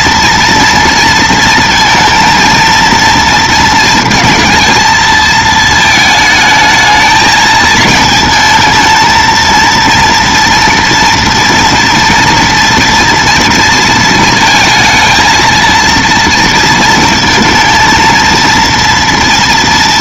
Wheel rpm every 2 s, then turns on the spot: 230, 230, 230, 220, 220, 230, 230, 220, 230, 230.
none